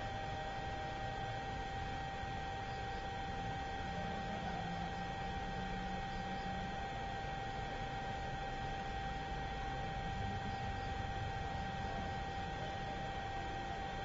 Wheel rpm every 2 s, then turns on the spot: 0, 0, 0, 0, 0, 0, 0.
none